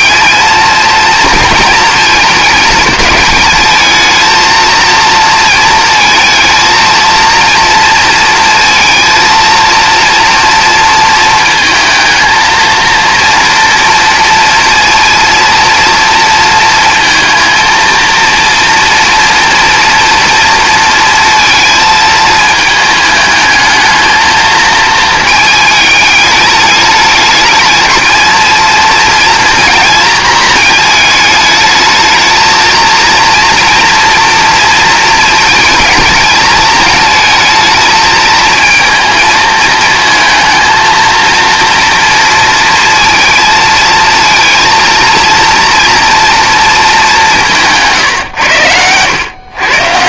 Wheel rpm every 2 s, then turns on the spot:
230, 220, 230, 230, 230, 230, 230, 230, 230, 230, 230, 220, 230, 210, 230, 220, 220, 230, 220, 220, 230, 230, 230, 220, 90.
48-50